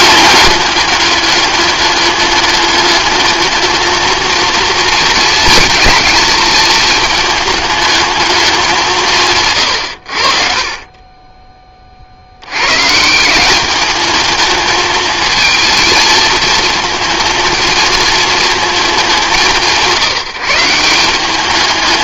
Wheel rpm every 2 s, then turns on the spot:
210, 210, 230, 220, 210, 70, 70, 210, 220, 220, 170.
none